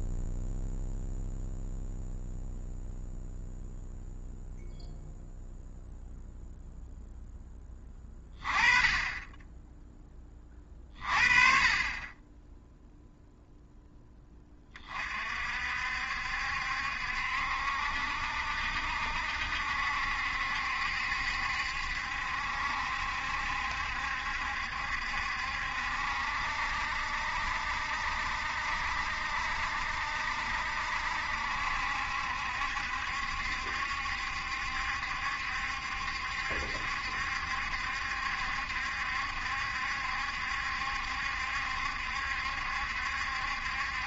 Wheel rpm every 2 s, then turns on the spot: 0, 0, 0, 0, 20, 30, 0, 30, 70, 70, 70, 70, 70, 70, 70, 70, 70, 70, 70, 70, 70, 70.
none